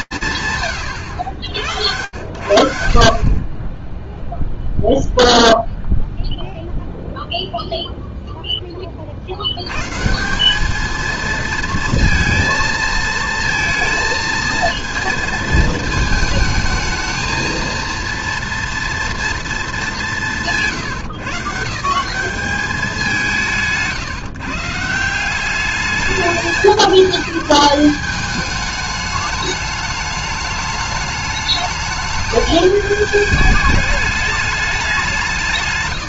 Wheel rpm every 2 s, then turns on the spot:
90, 0, 0, 0, 170, 230, 230, 220, 230, 190, 180, 150, 200, 190, 210, 210, 210, 160.
none